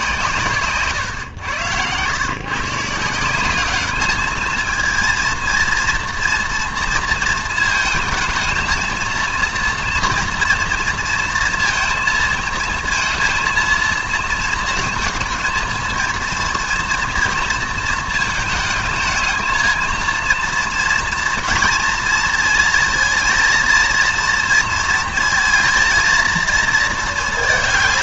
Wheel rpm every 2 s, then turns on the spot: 130, 150, 220, 230, 230, 230, 230, 220, 230, 220, 230, 230, 230, 220.
none